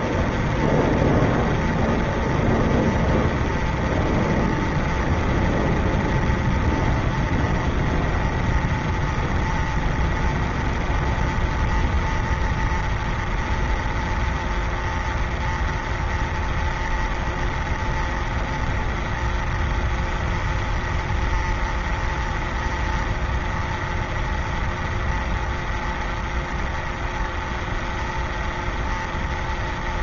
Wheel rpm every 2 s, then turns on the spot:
0, 0, 0, 0, 0, 0, 0, 0, 0, 0, 0, 0, 0, 0, 0.
none